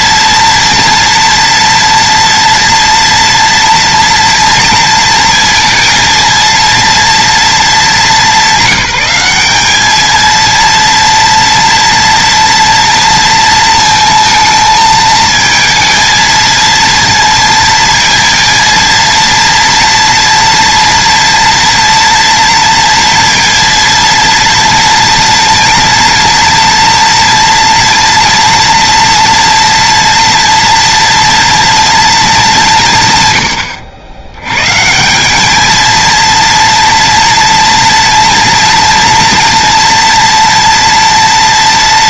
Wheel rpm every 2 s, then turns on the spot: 230, 230, 230, 240, 200, 230, 230, 220, 230, 230, 230, 230, 230, 230, 230, 230, 190, 130, 230, 230, 230.
none